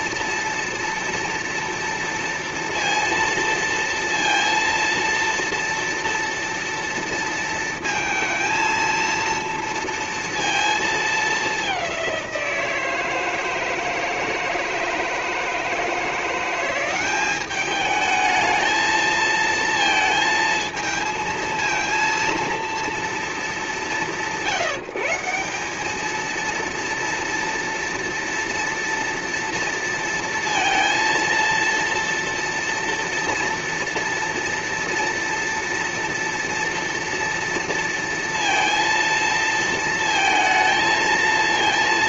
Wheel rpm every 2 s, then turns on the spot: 230, 230, 230, 230, 230, 230, 180, 160, 180, 220, 230, 230, 150, 230, 230, 230, 230, 230, 230, 230, 230.
none